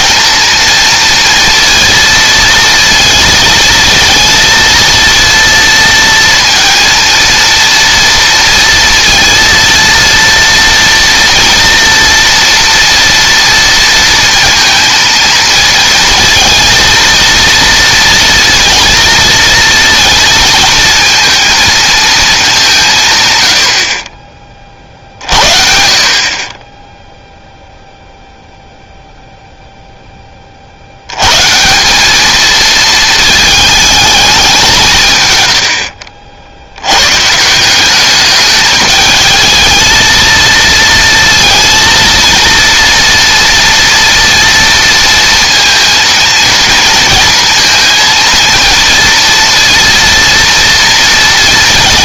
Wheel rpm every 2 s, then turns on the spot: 230, 230, 230, 230, 230, 230, 230, 230, 230, 230, 230, 130, 50, 0, 0, 80, 220, 150, 100, 210, 230, 230, 230, 230, 230, 230.
none